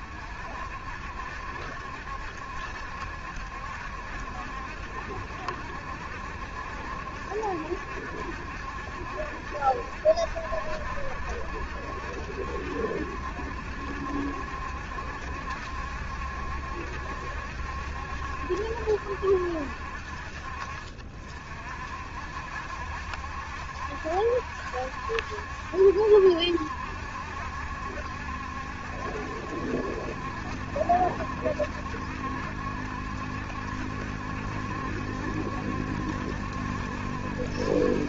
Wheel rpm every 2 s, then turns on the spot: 70, 70, 70, 70, 70, 70, 70, 70, 70, 60, 60, 70, 70, 70, 70, 70, 70, 70, 70.
none